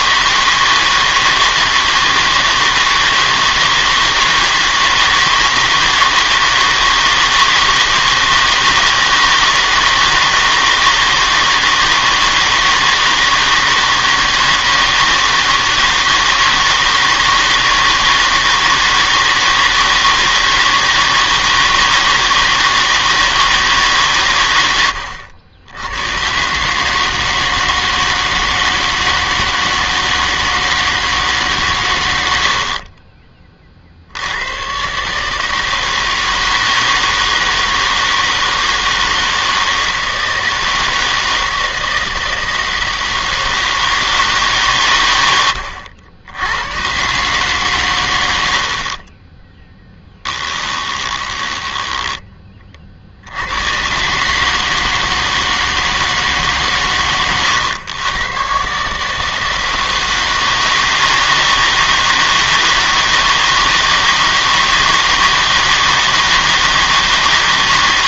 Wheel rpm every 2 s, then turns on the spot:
160, 160, 160, 160, 160, 160, 160, 160, 160, 160, 160, 160, 100, 140, 160, 160, 60, 110, 160, 160, 160, 160, 140, 100, 70, 10, 30, 150, 140, 140, 160, 160, 160, 160.
32-34 50-52